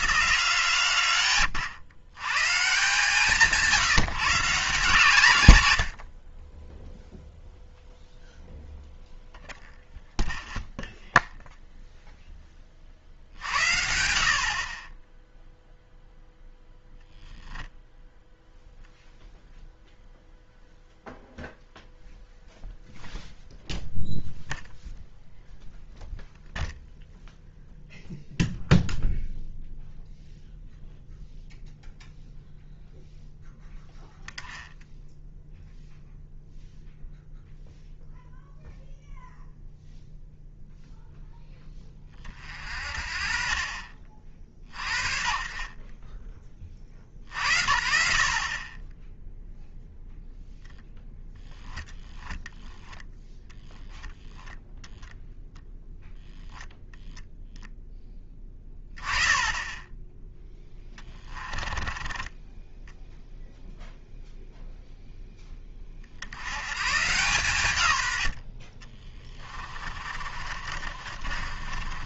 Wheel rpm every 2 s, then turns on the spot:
140, 130, 160, 10, 0, 0, 40, 30, 0, 0, 0, 0, 0, 0, 0, 0, 0, 0, 0, 0, 0, 60, 40, 40, 20, 0, 10, 0, 0, 10, 10, 10, 0, 110, 50, 50.
60-64 70-72